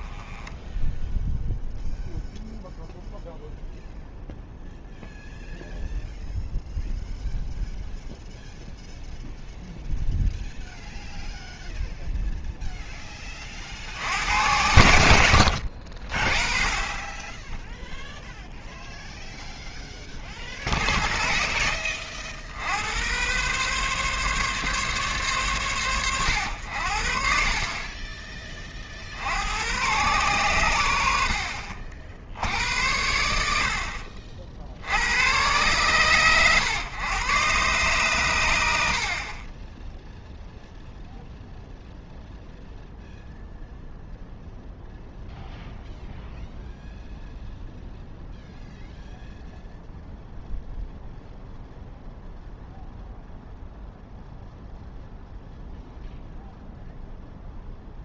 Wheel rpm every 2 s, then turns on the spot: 10, 0, 0, 0, 0, 0, 10, 80, 20, 0, 30, 80, 140, 70, 40, 90, 80, 70, 120, 70, 0, 0, 0, 0, 0, 0, 0, 0, 0.
none